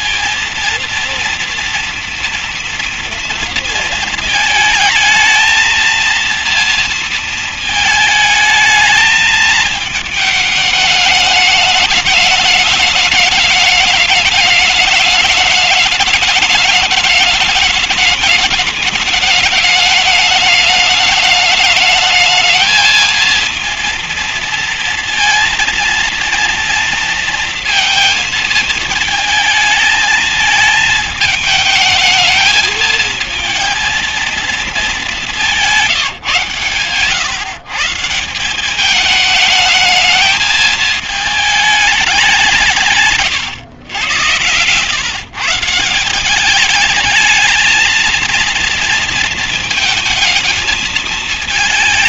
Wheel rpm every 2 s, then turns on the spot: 220, 230, 220, 230, 220, 220, 210, 210, 210, 210, 210, 210, 230, 230, 230, 210, 220, 230, 150, 170, 210, 200, 100, 170, 220, 230.
none